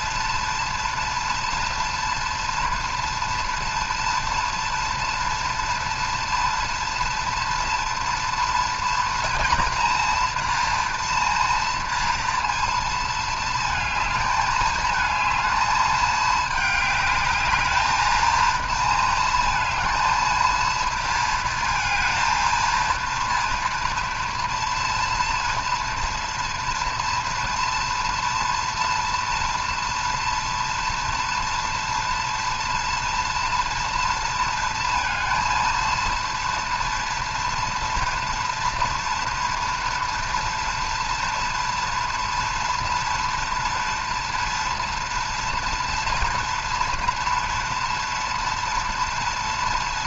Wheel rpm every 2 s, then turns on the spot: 230, 230, 230, 230, 230, 240, 230, 220, 210, 230, 230, 230, 230, 230, 230, 230, 230, 230, 230, 230, 230, 230, 240, 230, 240.
none